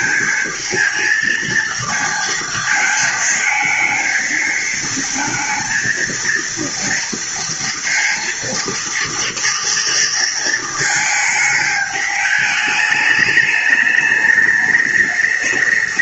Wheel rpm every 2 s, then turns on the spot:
230, 220, 230, 230, 230, 220, 210, 210.
none